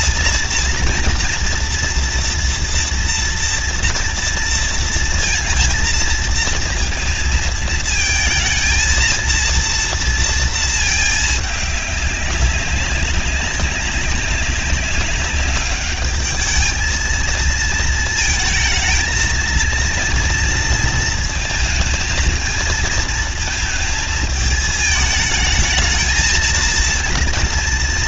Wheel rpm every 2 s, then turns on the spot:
230, 230, 230, 230, 230, 220, 190, 190, 220, 230, 230, 230, 220, 230.
none